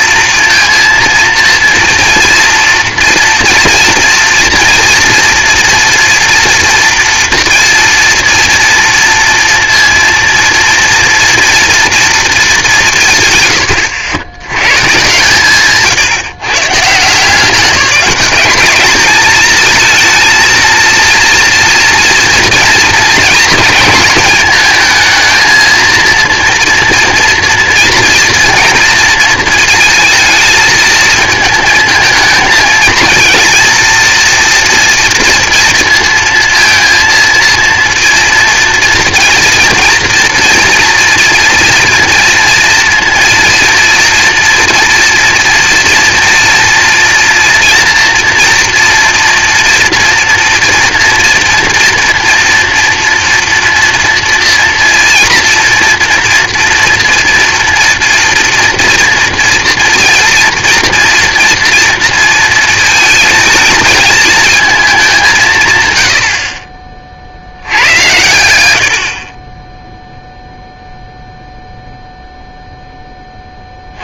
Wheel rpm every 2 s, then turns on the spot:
230, 230, 240, 230, 230, 230, 180, 120, 150, 210, 230, 220, 220, 230, 230, 220, 230, 230, 230, 230, 230, 230, 230, 240, 230, 230, 230, 230, 230, 240, 230, 220, 210, 30, 80, 0, 0.
none